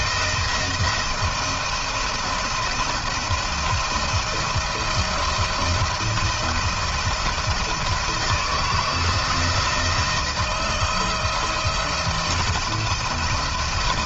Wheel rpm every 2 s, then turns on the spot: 170, 170, 170, 170, 160, 170, 160.
none